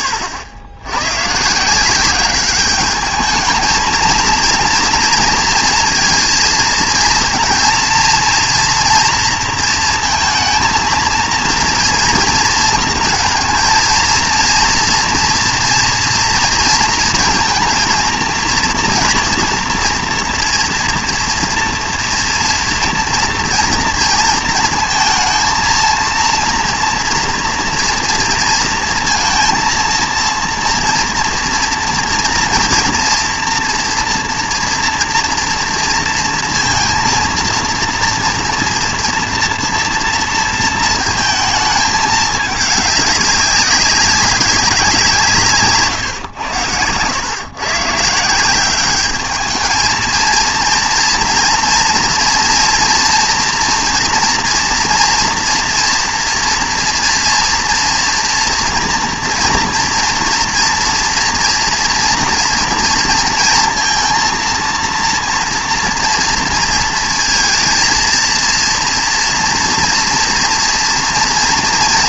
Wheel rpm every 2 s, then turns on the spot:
90, 200, 240, 230, 230, 230, 230, 230, 230, 230, 230, 230, 230, 230, 230, 230, 230, 230, 230, 230, 230, 210, 190, 100, 190, 230, 230, 230, 240, 230, 230, 230, 230, 230, 230, 230.
none